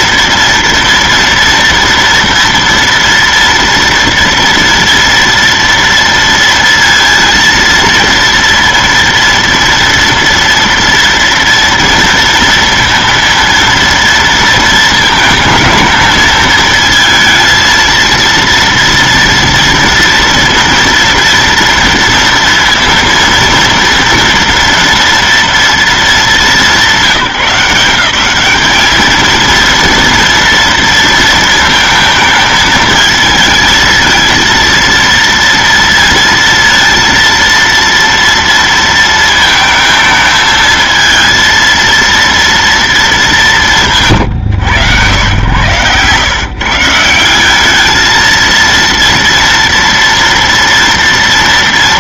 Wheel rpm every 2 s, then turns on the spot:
230, 230, 230, 230, 230, 230, 230, 230, 220, 230, 230, 230, 230, 200, 200, 230, 220, 230, 230, 230, 220, 230, 130, 140, 230, 230.
none